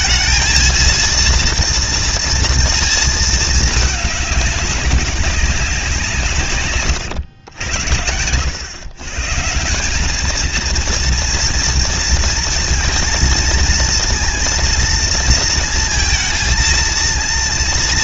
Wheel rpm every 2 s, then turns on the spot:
230, 230, 200, 150, 100, 220, 230, 230, 230.
none